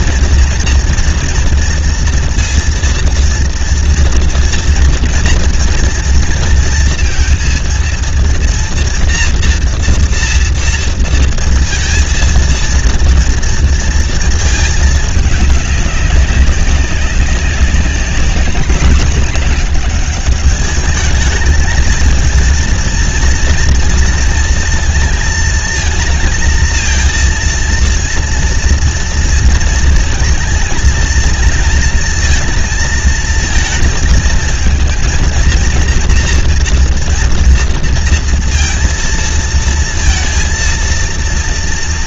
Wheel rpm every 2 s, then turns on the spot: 230, 230, 230, 230, 230, 240, 230, 220, 190, 200, 210, 220, 230, 220, 230, 230, 230, 220, 230, 230, 230.
none